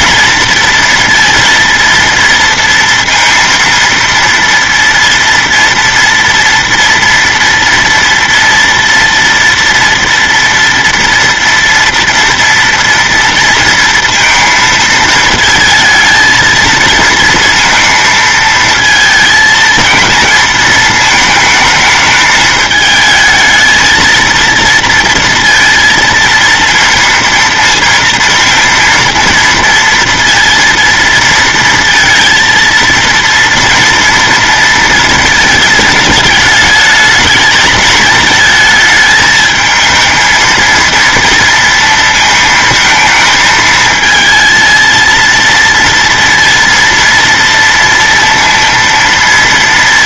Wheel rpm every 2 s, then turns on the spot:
230, 230, 230, 230, 230, 230, 230, 220, 230, 220, 220, 220, 230, 230, 230, 230, 230, 230, 220, 220, 230, 220, 230, 230, 230.
none